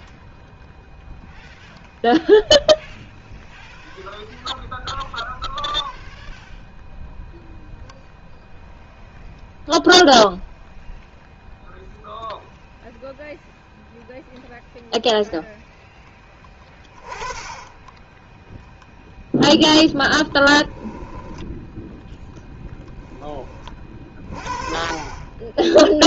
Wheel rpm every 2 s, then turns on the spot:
0, 0, 0, 0, 0, 0, 0, 0, 10, 0, 10, 20, 40.
22-24